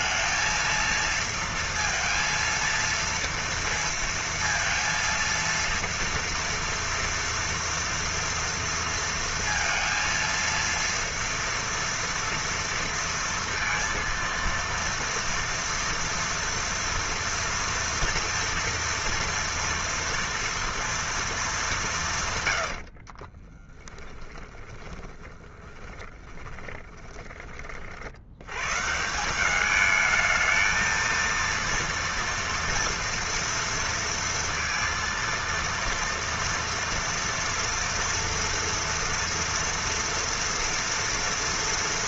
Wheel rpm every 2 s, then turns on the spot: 230, 230, 230, 230, 230, 230, 230, 230, 230, 230, 230, 110, 10, 20, 110, 220, 230, 230, 230, 230, 230.
24-28